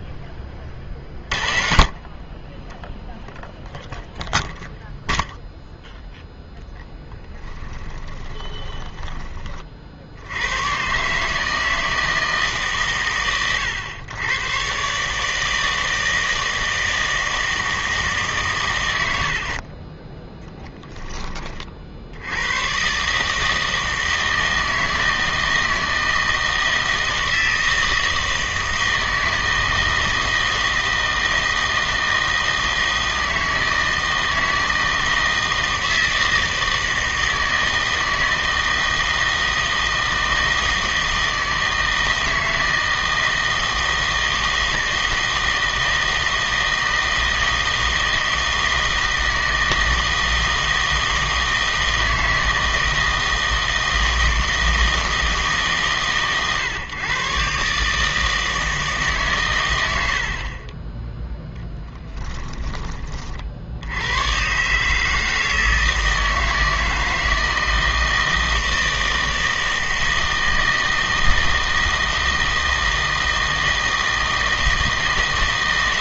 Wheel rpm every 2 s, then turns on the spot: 30, 10, 0, 0, 20, 110, 140, 130, 160, 100, 10, 120, 160, 160, 160, 160, 160, 160, 160, 160, 160, 160, 160, 160, 160, 160, 160, 160, 130, 160, 30, 20, 140, 160, 160, 160, 160, 160.
8-10 60-62